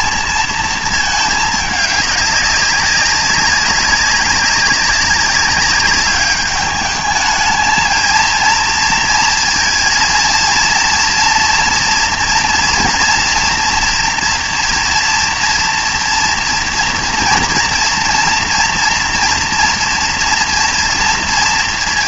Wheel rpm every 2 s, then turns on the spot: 220, 200, 190, 210, 230, 240, 240, 230, 230, 240, 240.
none